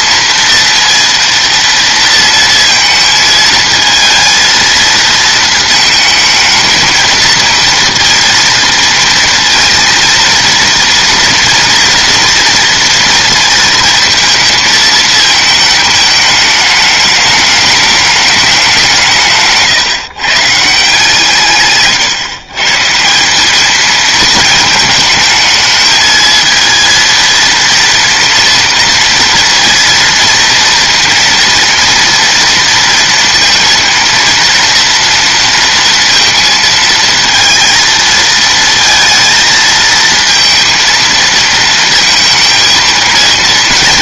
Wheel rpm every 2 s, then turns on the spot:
230, 230, 230, 220, 230, 230, 240, 220, 210, 200, 160, 140, 220, 230, 230, 230, 230, 230, 230, 230, 230, 230.
none